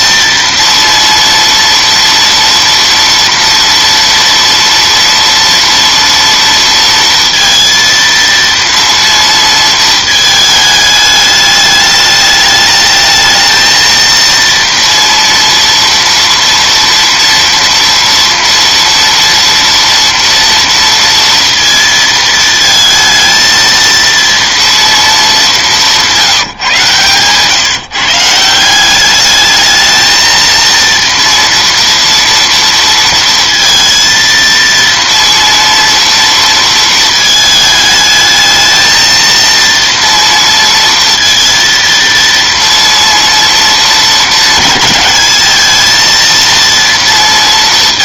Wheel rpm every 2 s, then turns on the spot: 230, 230, 230, 230, 230, 220, 210, 230, 240, 230, 230, 220, 230, 150, 170, 230, 230, 230, 230, 220, 230, 230, 220, 230.
none